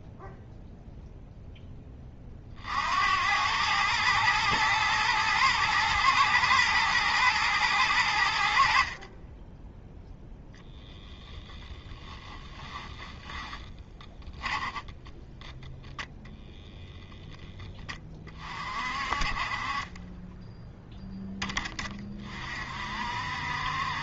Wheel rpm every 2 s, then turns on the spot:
0, 70, 110, 110, 50, 10, 10, 0, 0, 40, 10, 50.
12-14